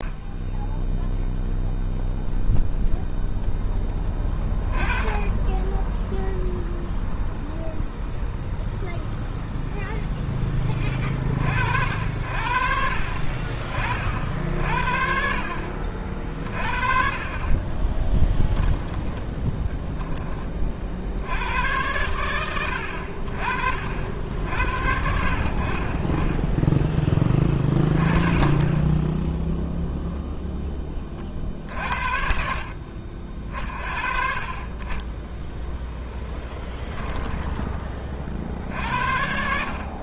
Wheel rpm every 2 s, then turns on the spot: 20, 0, 10, 0, 0, 20, 60, 50, 40, 10, 40, 90, 70, 10, 10, 20, 60, 30, 20, 60.
36-38